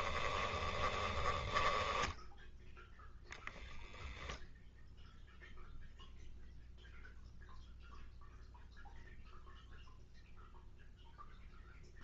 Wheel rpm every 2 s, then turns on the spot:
20, 0, 0, 0, 0, 0.
0-2